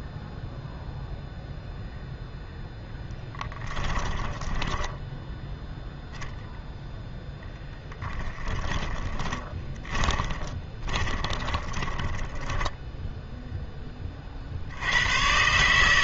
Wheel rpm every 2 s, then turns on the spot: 0, 0, 10, 0, 20, 20, 10, 60.
4-6 8-14